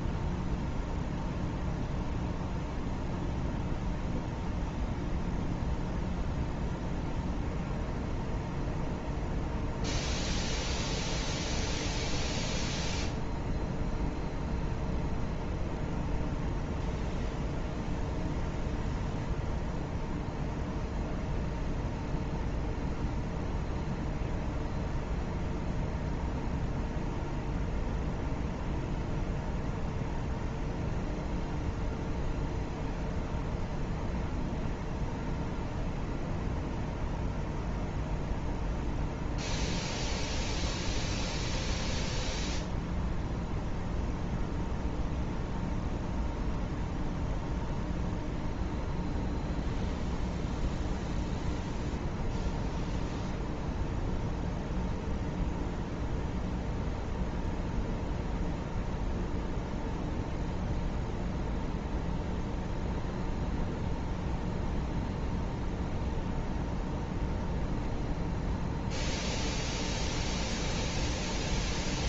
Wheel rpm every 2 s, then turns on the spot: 0, 0, 0, 0, 0, 0, 0, 0, 0, 0, 0, 0, 0, 0, 0, 0, 0, 0, 0, 0, 0, 0, 0, 0, 0, 0, 0, 0, 0, 0, 0, 0, 0, 0, 0, 0.
none